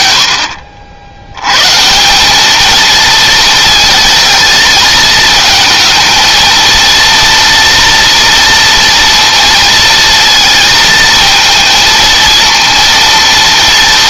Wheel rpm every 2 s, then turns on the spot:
70, 230, 220, 230, 230, 220, 230.
none